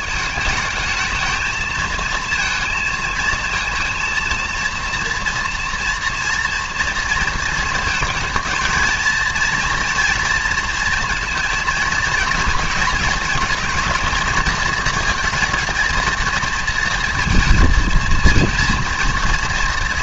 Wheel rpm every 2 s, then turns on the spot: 210, 230, 230, 240, 220, 230, 230, 220, 230, 230.
none